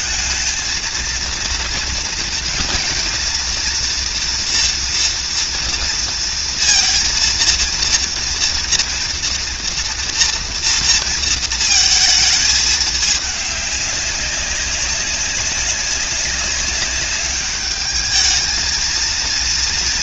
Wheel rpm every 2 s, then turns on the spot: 230, 230, 230, 230, 230, 230, 210, 200, 190, 220.
none